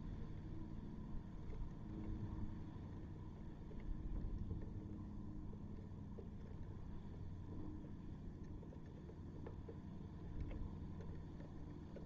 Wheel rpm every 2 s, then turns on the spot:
0, 0, 0, 0, 0, 0.
none